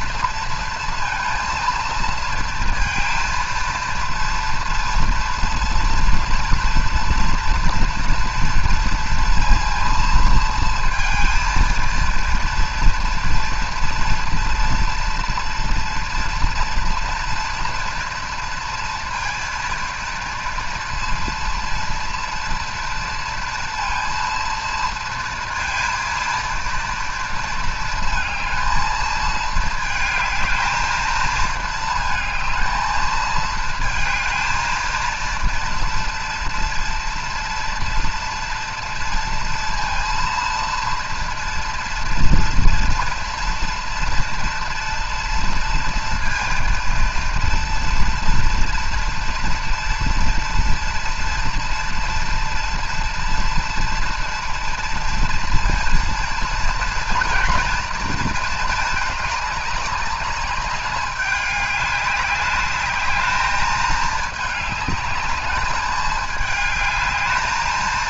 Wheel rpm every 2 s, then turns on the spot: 230, 230, 230, 230, 230, 230, 230, 230, 240, 230, 230, 230, 230, 230, 220, 220, 220, 230, 230, 230, 230, 230, 230, 230, 230, 230, 230, 230, 230, 220, 200, 210, 210, 210.
none